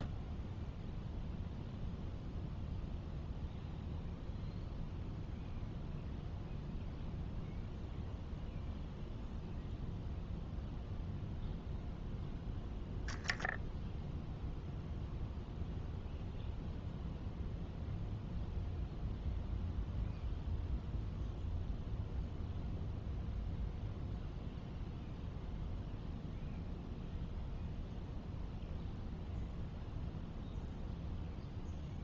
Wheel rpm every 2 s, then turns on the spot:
0, 0, 0, 0, 0, 0, 0, 0, 0, 0, 0, 0, 0, 0, 0, 0.
none